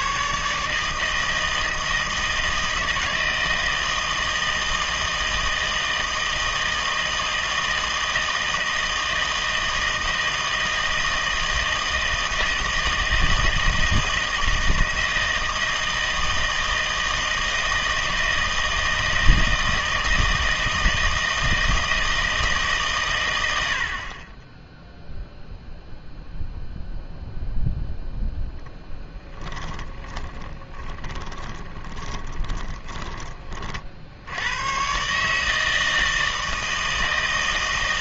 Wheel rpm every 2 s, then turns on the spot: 160, 160, 160, 160, 160, 160, 160, 160, 160, 160, 160, 90, 0, 0, 10, 20, 40, 150, 160.
28-32